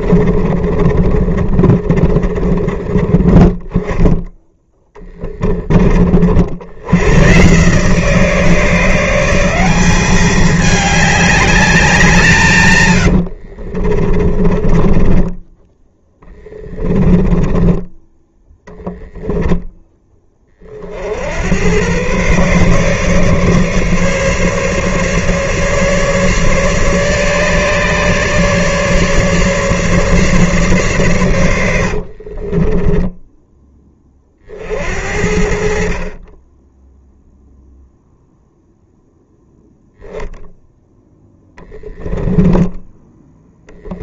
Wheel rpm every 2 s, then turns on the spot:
20, 20, 10, 90, 160, 210, 120, 30, 20, 10, 50, 140, 150, 140, 150, 130, 40, 50, 10, 0, 0, 10.
0-2 4-6 12-18 32-34